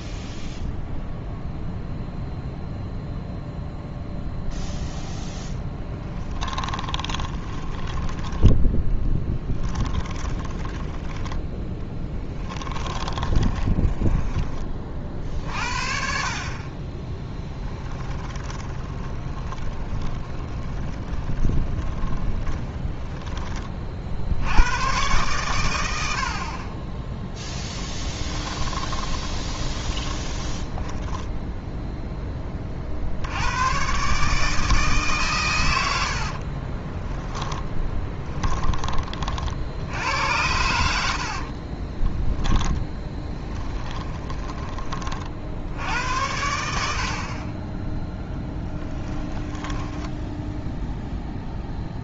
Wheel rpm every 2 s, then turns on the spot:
0, 0, 0, 30, 10, 20, 20, 40, 20, 20, 20, 10, 110, 20, 20, 10, 60, 140, 20, 30, 70, 10, 30, 70, 10, 0.
6-14 18-24 26-32 36-38 40-44 48-50